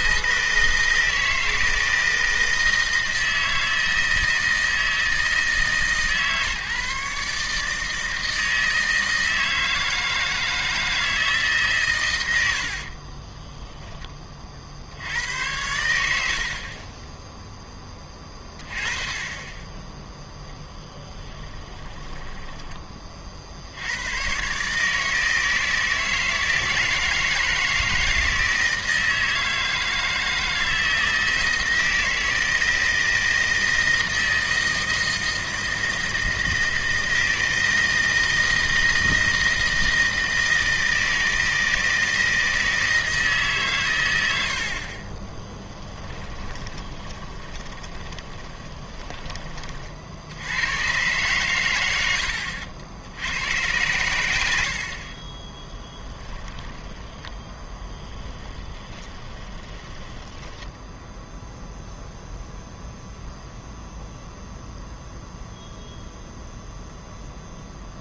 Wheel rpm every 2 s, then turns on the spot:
160, 160, 160, 140, 160, 160, 60, 60, 40, 30, 10, 20, 140, 160, 160, 160, 160, 160, 160, 160, 160, 160, 60, 20, 20, 100, 70, 70, 10, 20, 10, 0, 0, 0.
12-14 16-18 20-22 46-50 58-60